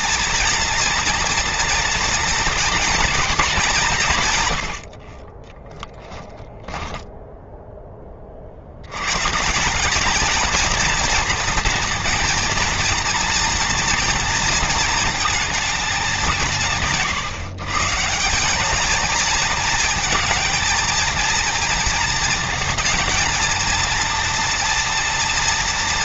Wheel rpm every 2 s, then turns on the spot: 230, 220, 50, 10, 130, 230, 230, 220, 140, 220, 220, 220, 230.
4-6